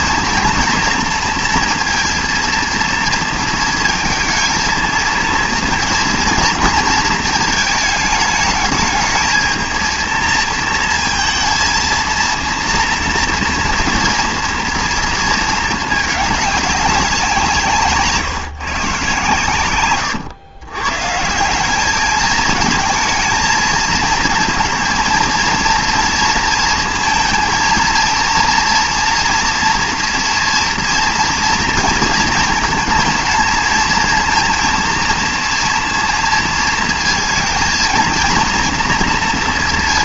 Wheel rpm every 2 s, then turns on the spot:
230, 230, 220, 230, 210, 230, 230, 230, 200, 150, 110, 220, 220, 230, 230, 240, 230, 230, 230, 230.
none